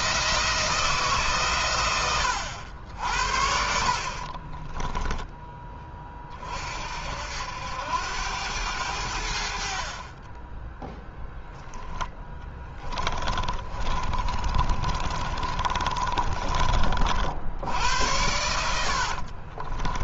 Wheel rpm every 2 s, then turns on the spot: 160, 80, 10, 50, 90, 10, 10, 30, 40, 80.
4-6 12-16 18-20